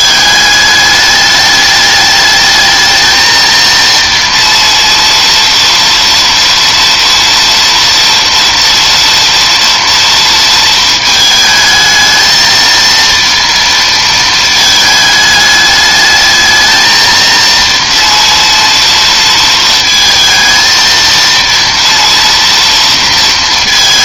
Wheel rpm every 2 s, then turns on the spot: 210, 220, 230, 230, 230, 230, 230, 220, 220, 230, 220, 230.
none